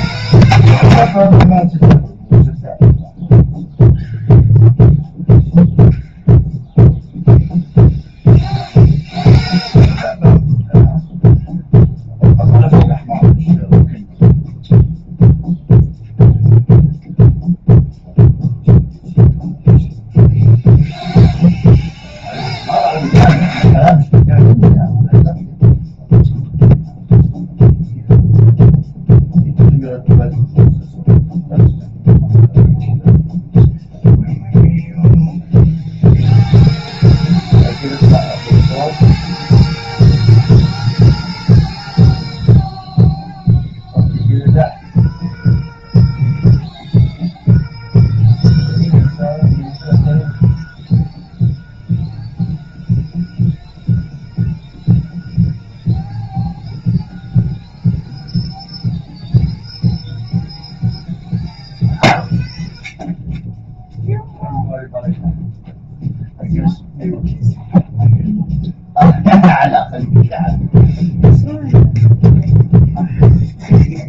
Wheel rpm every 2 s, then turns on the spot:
0, 0, 0, 0, 0, 0, 0, 0, 0, 0, 0, 0, 0, 0, 0, 0, 0, 0, 0, 0, 0, 0, 0, 0, 0, 0, 0, 0, 0, 0, 0, 0, 0, 0, 0, 0, 0.
none